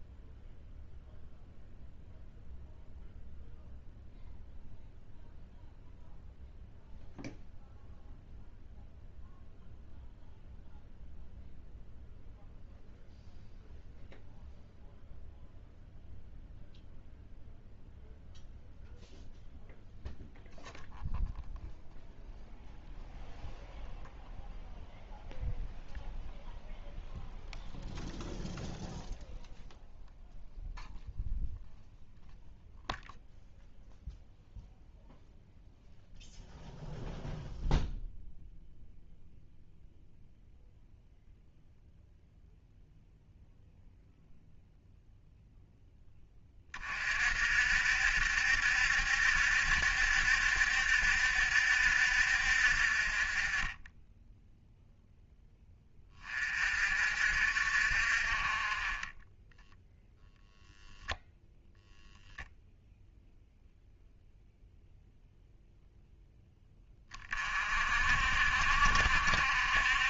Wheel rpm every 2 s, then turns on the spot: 0, 0, 0, 0, 0, 0, 0, 0, 0, 0, 0, 0, 0, 0, 0, 0, 0, 0, 0, 0, 0, 0, 0, 30, 70, 70, 50, 0, 40, 30, 0, 0, 0, 10, 50.
none